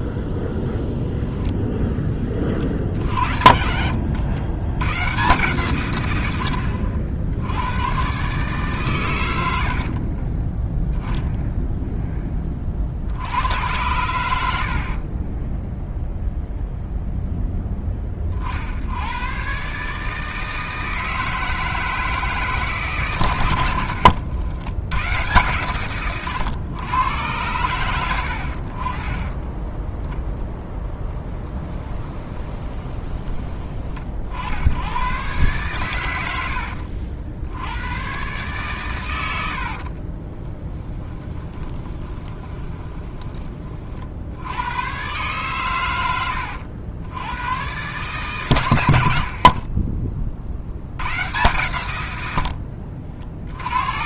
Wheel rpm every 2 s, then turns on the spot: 10, 40, 80, 50, 140, 20, 30, 70, 0, 60, 160, 150, 100, 110, 60, 10, 20, 80, 70, 140, 20, 20, 80, 90, 130, 60, 80.
10-12 32-34 40-44